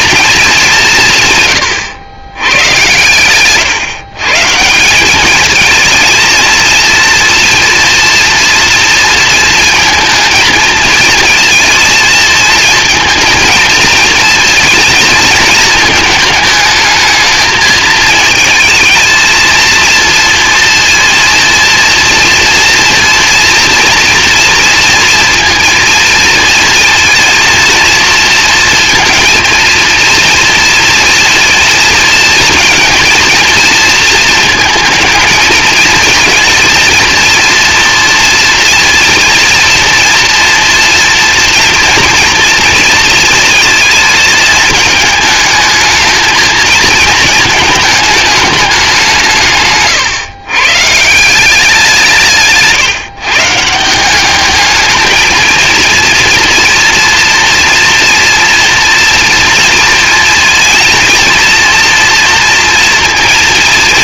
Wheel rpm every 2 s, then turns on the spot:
180, 110, 180, 230, 230, 220, 220, 230, 220, 220, 230, 230, 230, 230, 230, 230, 230, 220, 230, 230, 230, 230, 220, 220, 190, 150, 150, 220, 240, 230, 230, 230.
none